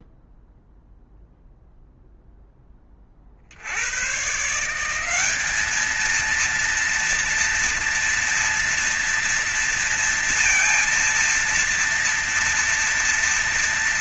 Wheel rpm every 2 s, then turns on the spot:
0, 0, 140, 220, 240, 230, 230.
none